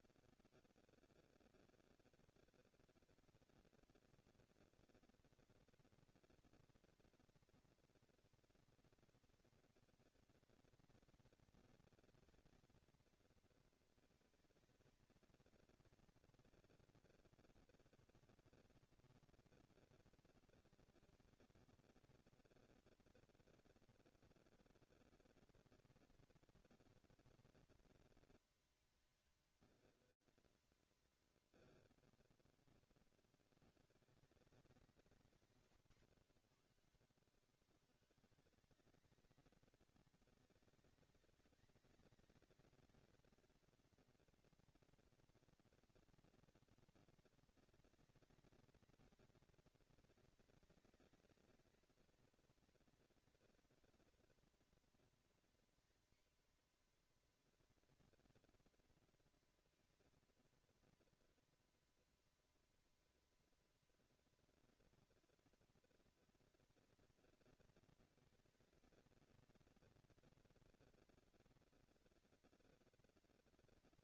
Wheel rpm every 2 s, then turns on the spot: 200, 230, 230, 230, 230, 230, 230, 220, 230, 230, 230, 240, 230, 230, 220, 140, 20, 170, 90, 190, 210, 220, 220, 220, 220, 220, 230, 230, 240, 230, 230, 230, 230, 230, 230, 230, 230.
none